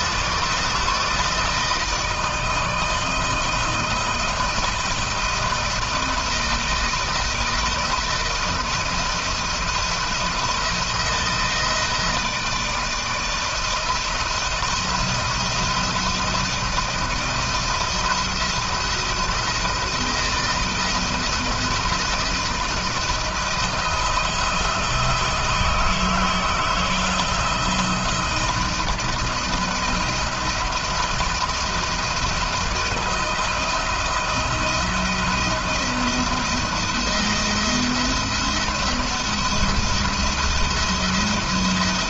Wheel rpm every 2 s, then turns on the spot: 160, 160, 160, 170, 160, 160, 160, 170, 170, 170, 160, 160, 160, 160, 170, 170, 160, 160, 170, 170, 170.
none